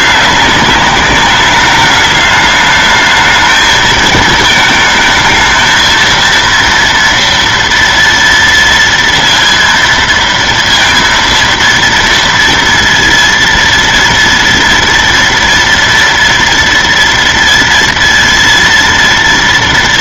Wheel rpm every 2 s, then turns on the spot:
200, 210, 220, 230, 230, 230, 230, 230, 230, 230.
none